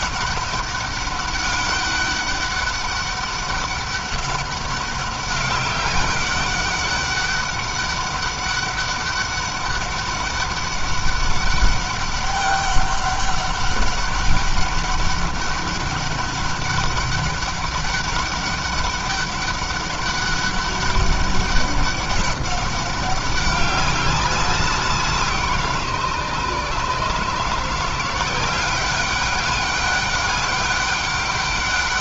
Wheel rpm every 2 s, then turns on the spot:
200, 200, 200, 200, 200, 200, 200, 200, 200, 200, 200, 200, 180, 150, 190, 200.
none